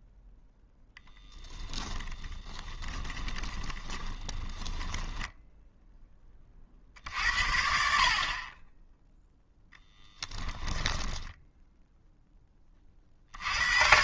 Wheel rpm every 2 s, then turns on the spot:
0, 20, 20, 30, 0, 10, 20.
2-6